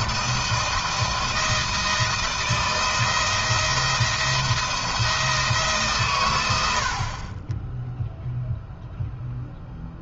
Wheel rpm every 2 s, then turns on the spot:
170, 170, 170, 70, 0.
none